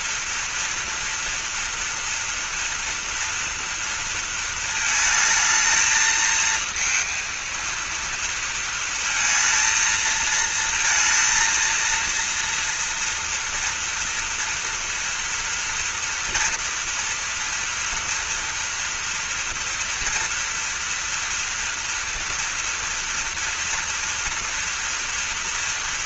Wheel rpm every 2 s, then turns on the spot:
240, 230, 220, 230, 230, 230, 230, 230, 230, 230, 230, 230, 230.
none